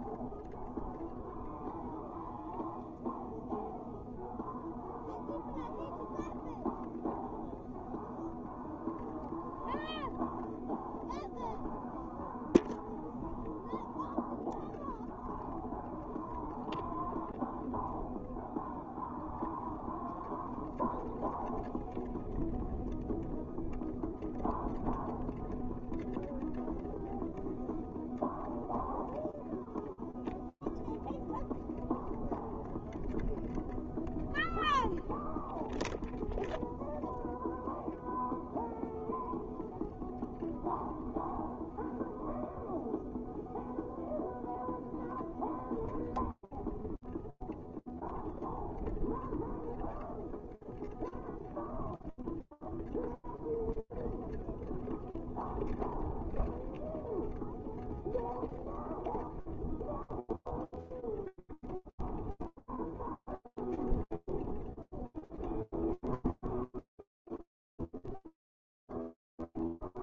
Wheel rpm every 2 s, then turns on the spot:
0, 0, 0, 0, 0, 0, 0, 0, 0, 0, 0, 0, 0, 0, 0, 0, 0, 0, 0, 0, 0, 0, 0, 0, 0, 0, 0, 0, 0, 0, 0, 0, 0, 0, 0.
none